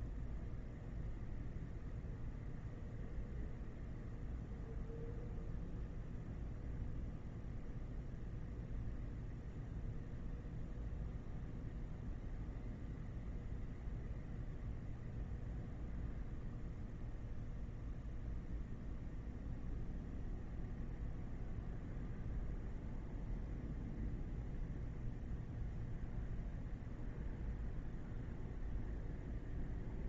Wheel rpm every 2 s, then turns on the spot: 0, 0, 0, 0, 0, 0, 0, 0, 0, 0, 0, 0, 0, 0, 0.
none